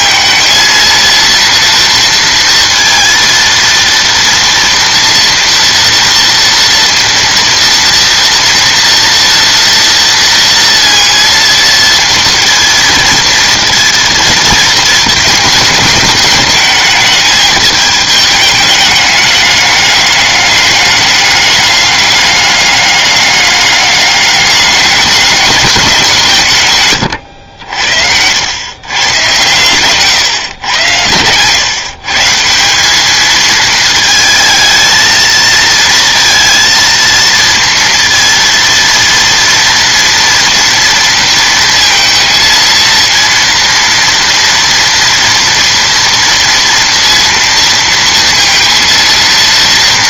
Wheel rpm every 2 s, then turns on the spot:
230, 230, 230, 230, 230, 230, 230, 230, 210, 210, 200, 200, 200, 160, 110, 120, 170, 220, 230, 230, 230, 230, 230, 230, 230.
none